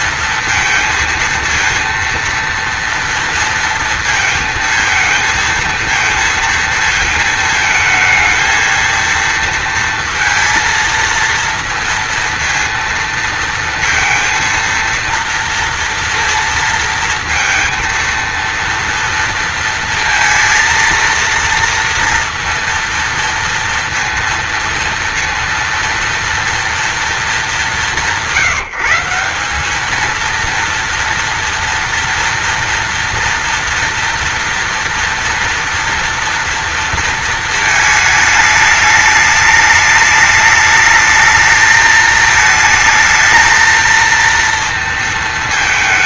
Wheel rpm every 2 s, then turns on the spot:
230, 230, 220, 220, 230, 230, 230, 230, 230, 230, 230, 230, 230, 210, 170, 230, 230, 230, 230, 210, 220, 220, 230.
none